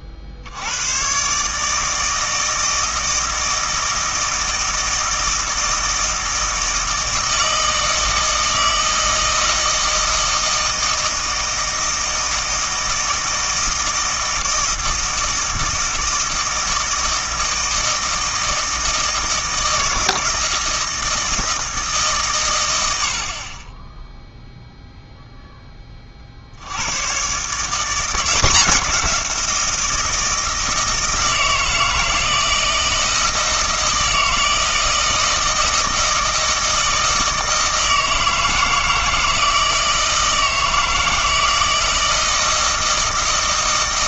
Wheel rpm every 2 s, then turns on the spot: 90, 160, 160, 160, 160, 160, 160, 160, 160, 160, 160, 90, 0, 90, 180, 160, 160, 160, 160, 160, 160, 160.
none